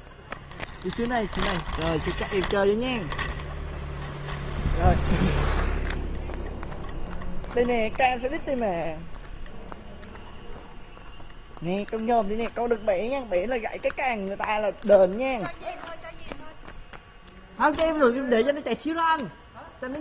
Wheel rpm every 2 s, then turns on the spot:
0, 0, 0, 0, 0, 0, 0, 0, 0, 0.
none